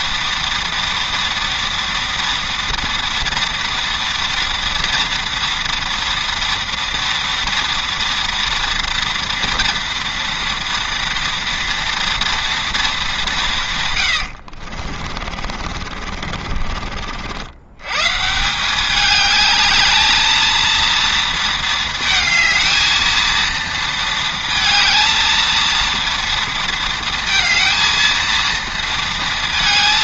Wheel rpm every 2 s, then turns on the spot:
230, 230, 240, 230, 230, 230, 230, 60, 40, 190, 230, 220, 220, 230, 230.
14-16